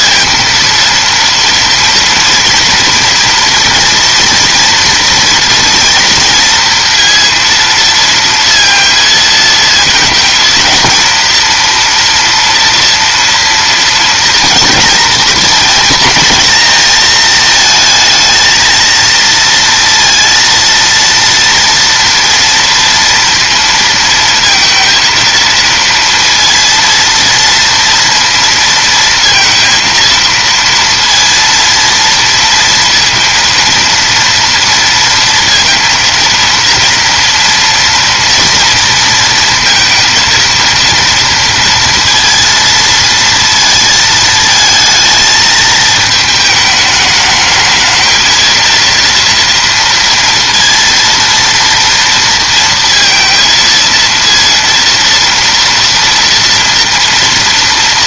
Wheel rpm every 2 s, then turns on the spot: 230, 230, 230, 230, 230, 230, 230, 220, 230, 230, 230, 230, 230, 230, 230, 230, 230, 230, 230, 230, 230, 230, 220, 210, 230, 230, 230, 230, 230.
none